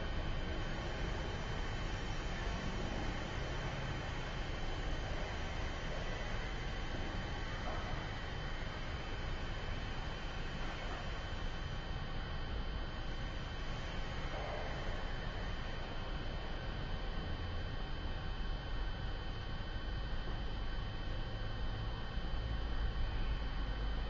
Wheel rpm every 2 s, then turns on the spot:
0, 0, 0, 0, 0, 0, 0, 0, 0, 0, 0, 0.
none